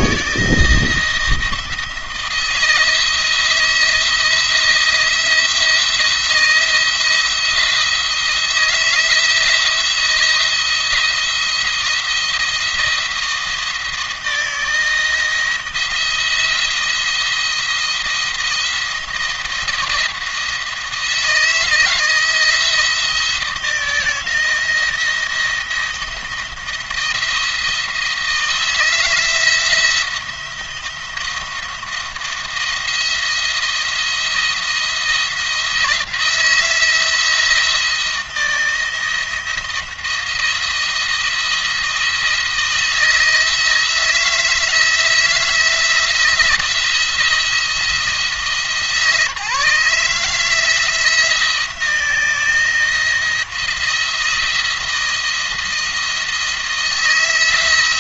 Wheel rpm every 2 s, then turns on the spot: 170, 170, 160, 170, 160, 170, 170, 160, 170, 170, 170, 160, 170, 170, 170, 170, 170, 170, 160, 160, 170, 170, 160, 170, 160, 160, 170, 170, 170.
none